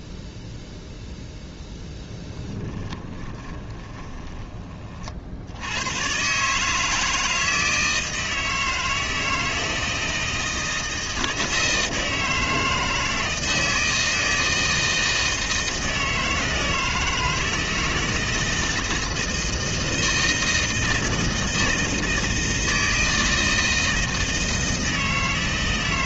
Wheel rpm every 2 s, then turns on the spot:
0, 20, 50, 150, 160, 160, 160, 160, 160, 160, 160, 160, 160.
2-6